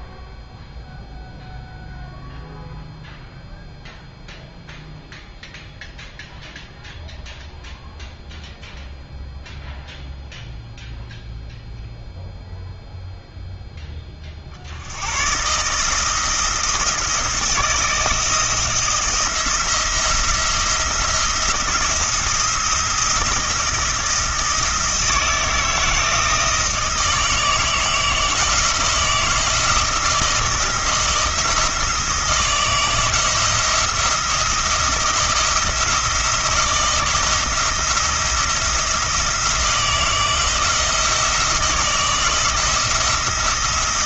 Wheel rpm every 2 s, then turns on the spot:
0, 0, 0, 0, 0, 0, 0, 70, 160, 160, 170, 170, 160, 160, 160, 170, 160, 170, 170, 170, 160, 160.
none